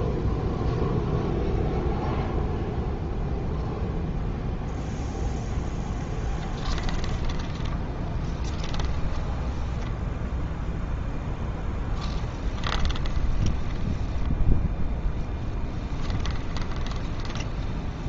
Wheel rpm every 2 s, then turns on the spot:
0, 0, 0, 10, 20, 0, 20, 20, 20.
6-10 12-18